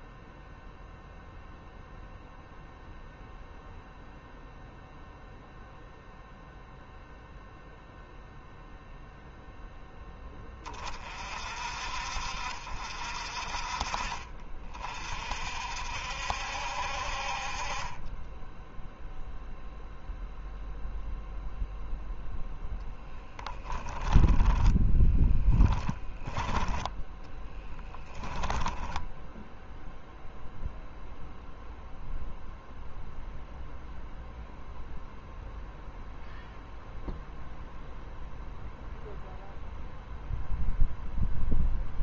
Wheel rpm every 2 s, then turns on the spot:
0, 0, 0, 0, 0, 40, 50, 40, 60, 0, 0, 0, 10, 10, 10, 0, 0, 0, 0, 0, 0.
24-28